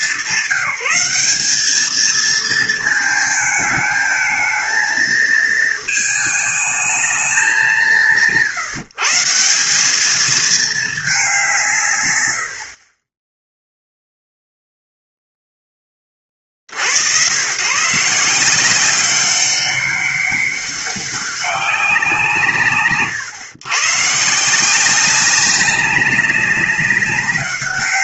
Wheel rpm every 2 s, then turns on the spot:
190, 220, 220, 200, 160, 190, 10, 0, 100, 190, 200, 110, 190, 180.
12-14